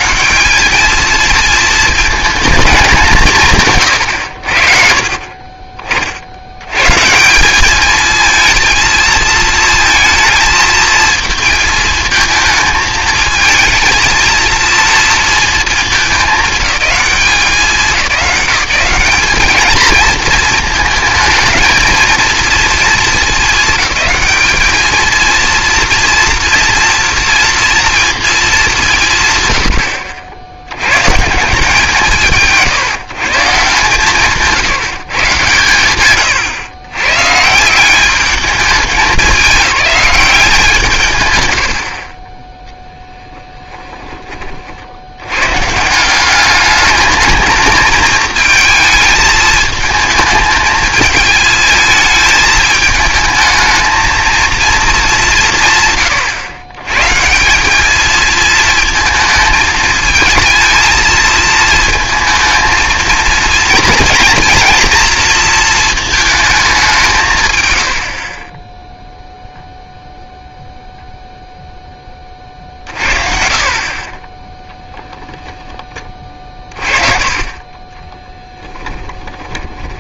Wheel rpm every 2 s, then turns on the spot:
170, 220, 90, 80, 230, 220, 220, 230, 190, 180, 220, 230, 220, 230, 210, 100, 160, 160, 130, 210, 190, 10, 50, 210, 220, 220, 220, 230, 140, 220, 230, 230, 230, 200, 10, 0, 50, 0, 40, 20.
78-80